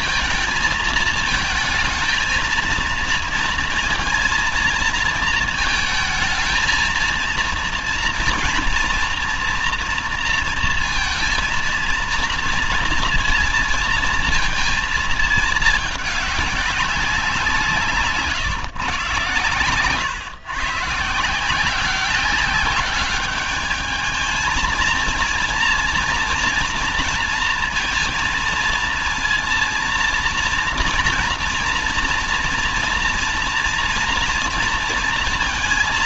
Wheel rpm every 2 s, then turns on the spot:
220, 230, 230, 220, 230, 230, 230, 230, 200, 140, 140, 190, 220, 230, 230, 230, 230, 240.
none